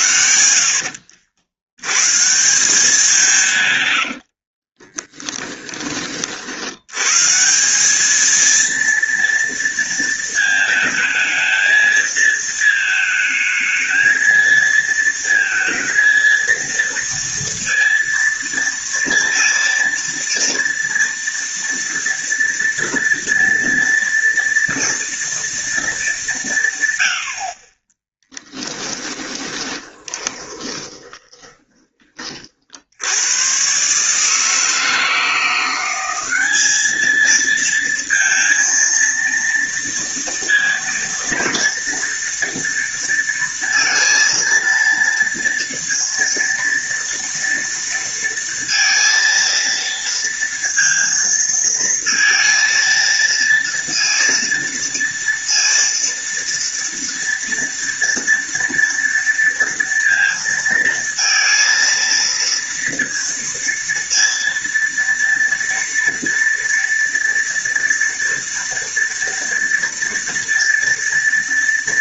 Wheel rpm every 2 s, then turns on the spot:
70, 180, 20, 100, 230, 220, 220, 230, 230, 230, 230, 230, 230, 110, 20, 20, 70, 160, 210, 230, 230, 230, 230, 230, 230, 230, 230, 230, 230, 230, 230, 230, 230, 230, 230, 230.
4-6 28-32